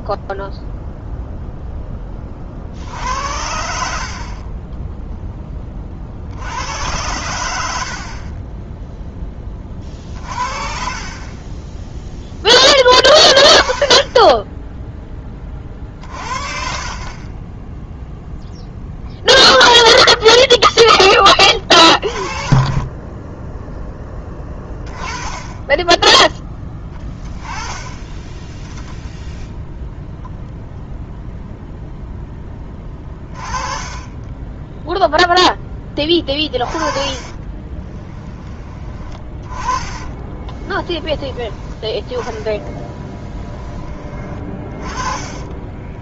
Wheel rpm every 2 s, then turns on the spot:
0, 60, 10, 100, 10, 40, 20, 10, 40, 0, 10, 20, 10, 10, 0, 0, 20, 0, 30, 20, 10, 10, 30.
8-10 16-18 20-24 32-34 36-38 42-46